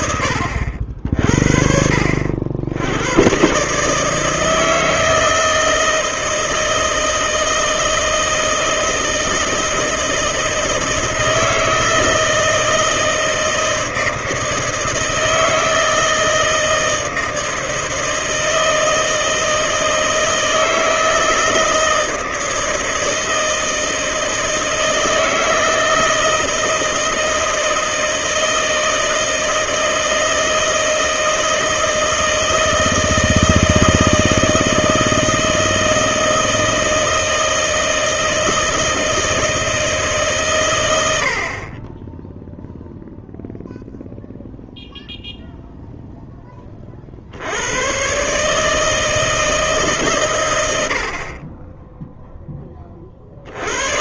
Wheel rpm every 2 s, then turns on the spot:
70, 80, 160, 160, 160, 160, 160, 160, 160, 160, 160, 160, 160, 160, 160, 160, 160, 160, 160, 160, 120, 0, 0, 30, 160, 90, 30.
none